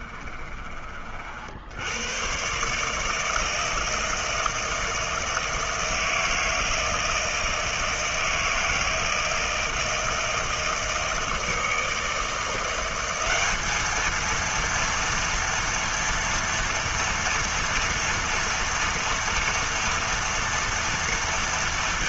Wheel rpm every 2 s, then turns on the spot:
50, 150, 160, 160, 160, 160, 190, 230, 230, 230, 230.
none